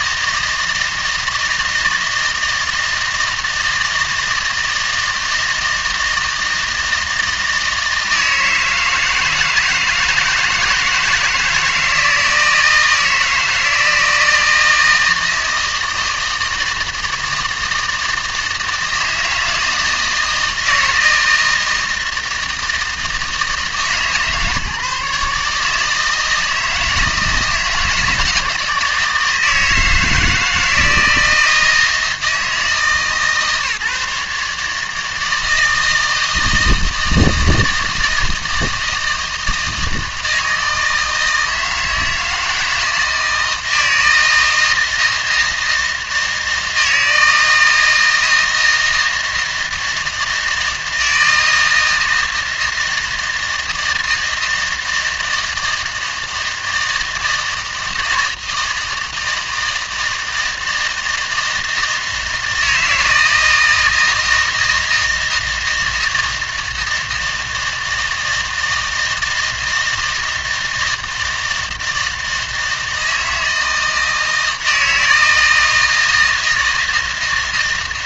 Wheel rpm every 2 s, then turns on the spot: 160, 160, 160, 160, 160, 160, 160, 160, 160, 160, 160, 160, 150, 160, 160, 160, 160, 150, 160, 160, 160, 160, 160, 160, 160, 160, 160, 160, 160, 160, 160, 160, 160, 160, 160, 160, 160, 160, 160.
none